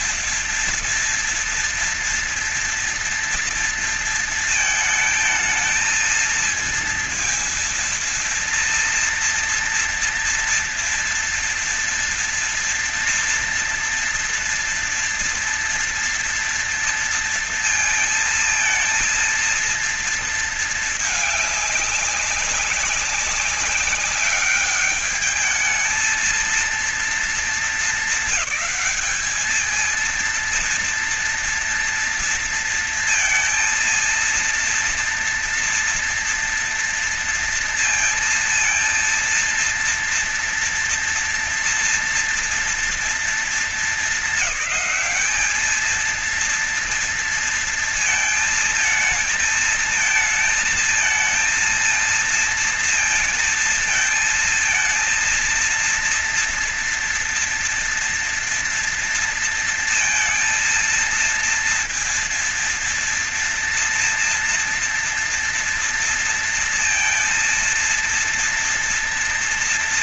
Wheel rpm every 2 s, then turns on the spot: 230, 230, 230, 230, 230, 230, 230, 230, 230, 230, 230, 190, 200, 220, 220, 230, 230, 230, 230, 230, 230, 230, 210, 220, 230, 220, 230, 220, 230, 230, 230, 230, 230, 230, 230.
none